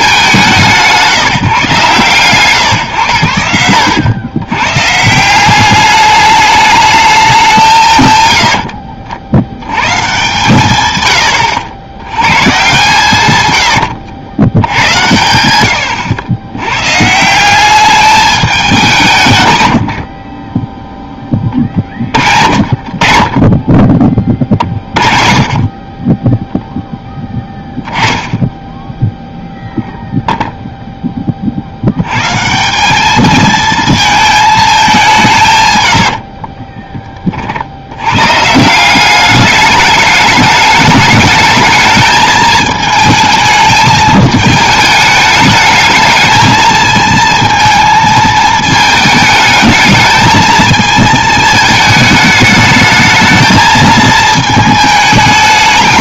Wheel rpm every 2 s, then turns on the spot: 150, 130, 120, 210, 80, 130, 130, 90, 100, 200, 10, 50, 40, 0, 10, 0, 180, 210, 30, 170, 210, 220, 220, 220, 220, 220, 210, 220.
20-22 36-38